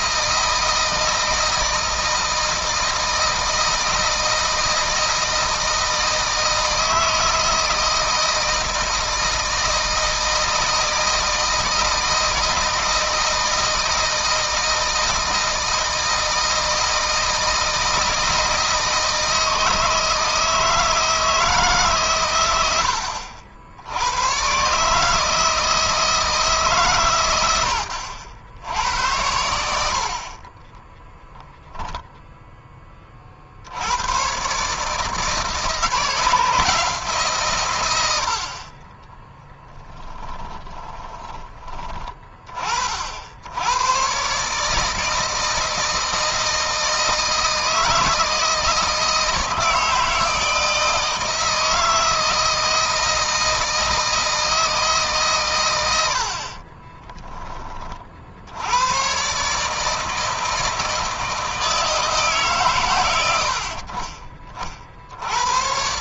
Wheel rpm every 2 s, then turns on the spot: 160, 160, 160, 160, 160, 160, 160, 170, 160, 160, 160, 90, 130, 140, 80, 20, 20, 140, 160, 30, 20, 50, 150, 160, 160, 160, 160, 160, 30, 100, 160, 130, 50.
30-32 40-42 56-58